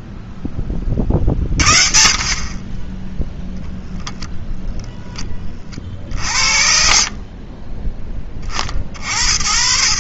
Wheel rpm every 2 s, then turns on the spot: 20, 50, 0, 40, 40.
none